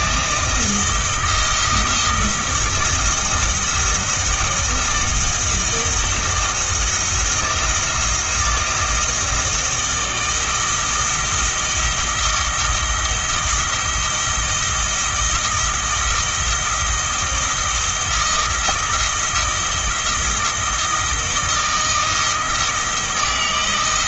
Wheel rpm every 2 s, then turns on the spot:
160, 170, 160, 160, 170, 160, 160, 170, 170, 160, 160, 160.
none